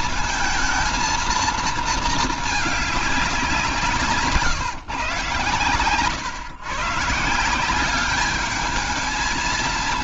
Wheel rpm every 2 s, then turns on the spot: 220, 210, 130, 150, 220.
none